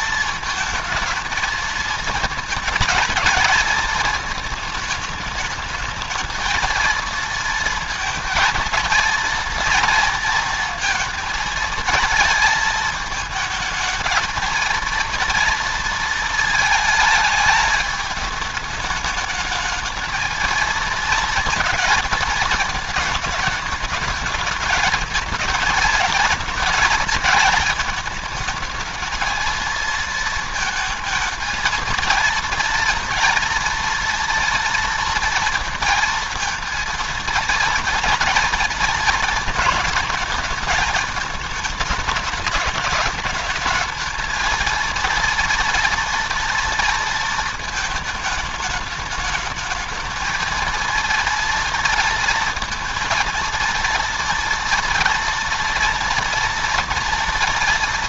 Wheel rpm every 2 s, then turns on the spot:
220, 230, 210, 230, 230, 230, 220, 230, 220, 210, 230, 220, 220, 220, 220, 230, 230, 230, 230, 230, 210, 210, 230, 230, 210, 230, 230, 230, 230.
none